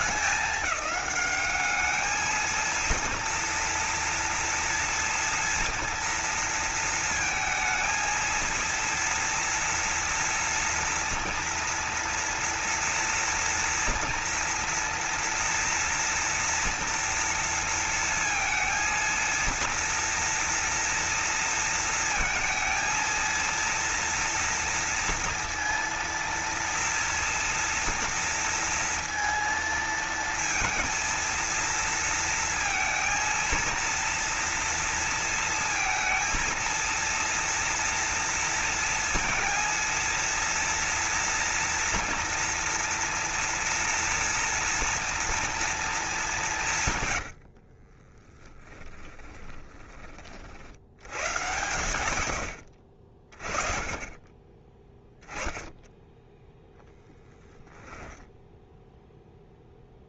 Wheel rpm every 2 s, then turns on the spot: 200, 230, 230, 230, 230, 230, 230, 230, 230, 230, 230, 230, 230, 230, 230, 230, 230, 230, 230, 230, 230, 230, 230, 120, 30, 100, 50, 10, 10, 0.
46-50 56-58